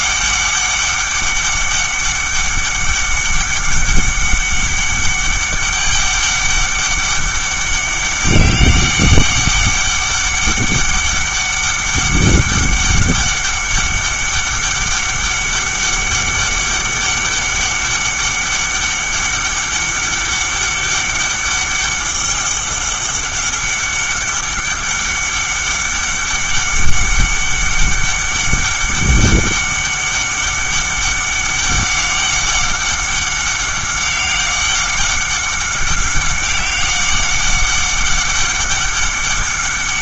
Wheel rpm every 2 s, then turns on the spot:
200, 200, 200, 200, 200, 200, 200, 200, 200, 200, 200, 200, 200, 200, 200, 200, 200, 190, 200, 200.
none